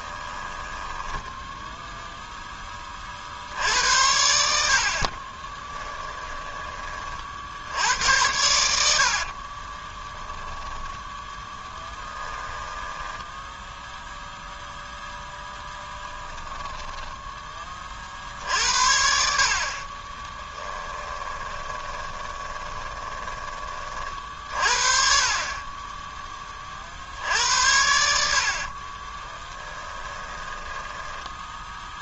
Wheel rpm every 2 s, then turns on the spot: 20, 20, 60, 20, 70, 20, 10, 0, 0, 70, 10, 20, 60, 40, 40, 10.
0-2 12-14 20-24 28-32